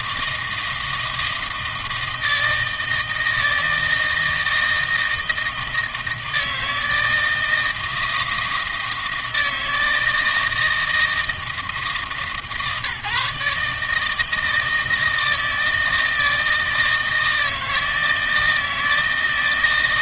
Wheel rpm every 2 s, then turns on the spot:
160, 160, 160, 160, 160, 160, 150, 160, 160, 160.
none